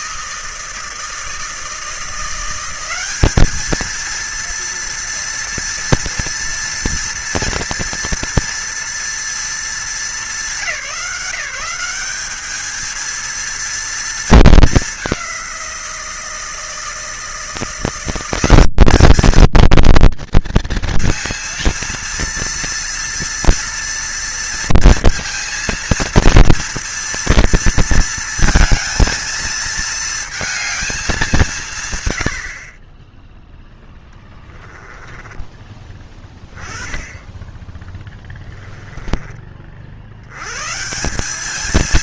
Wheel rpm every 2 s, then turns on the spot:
160, 180, 230, 230, 240, 200, 220, 220, 170, 200, 230, 230, 230, 230, 230, 220, 50, 10, 10, 10, 120.
34-36 38-40